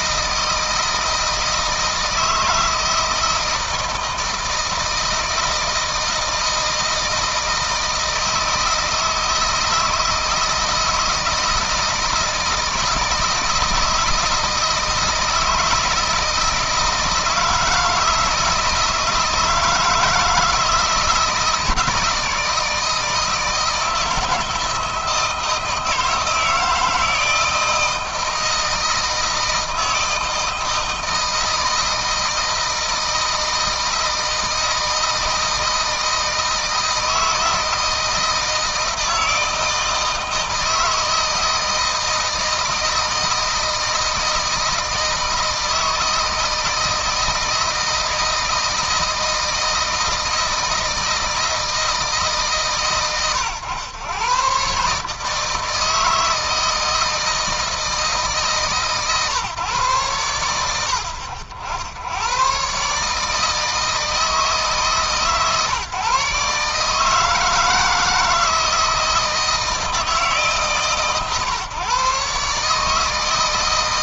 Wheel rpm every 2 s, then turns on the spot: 160, 160, 160, 160, 160, 160, 160, 160, 160, 160, 160, 160, 160, 160, 160, 160, 160, 160, 160, 160, 160, 160, 160, 160, 160, 160, 130, 130, 160, 150, 80, 120, 150, 150, 160, 140, 150.
none